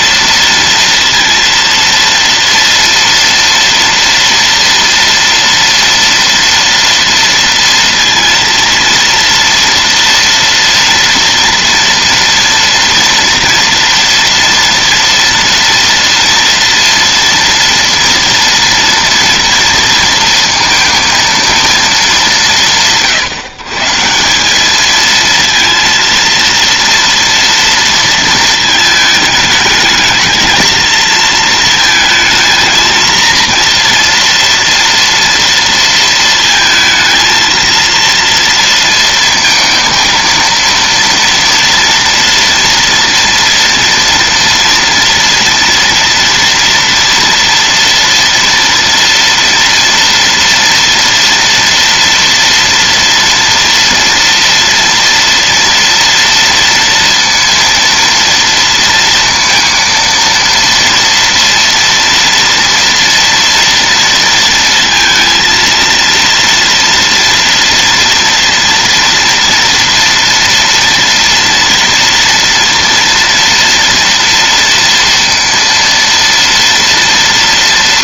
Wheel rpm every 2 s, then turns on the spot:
230, 230, 230, 230, 230, 230, 230, 230, 230, 230, 230, 170, 200, 230, 230, 220, 220, 230, 220, 230, 230, 240, 230, 230, 230, 230, 230, 230, 230, 230, 230, 230, 230, 230, 230, 230, 230, 230, 230.
none